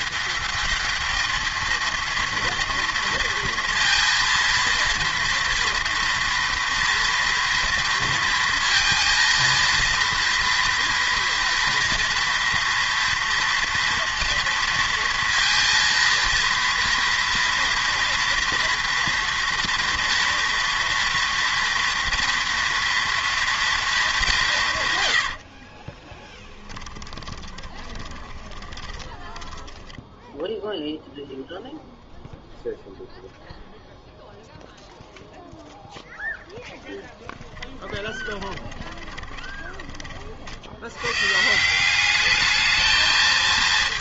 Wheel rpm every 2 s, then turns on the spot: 210, 230, 230, 230, 230, 230, 230, 230, 230, 230, 230, 230, 150, 10, 20, 0, 0, 0, 0, 20, 80, 210.
26-30 38-40